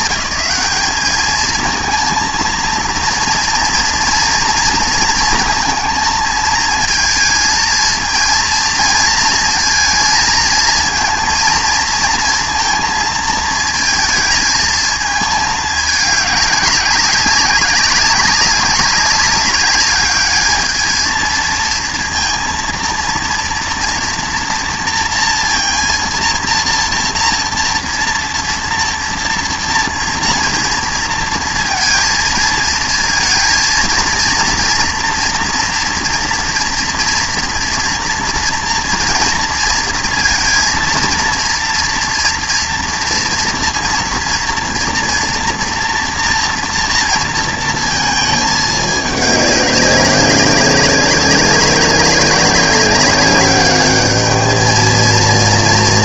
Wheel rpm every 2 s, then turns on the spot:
210, 230, 230, 220, 220, 230, 230, 220, 200, 190, 210, 230, 230, 230, 230, 230, 230, 230, 240, 230, 230, 230, 230, 230, 220, 200, 200, 220.
none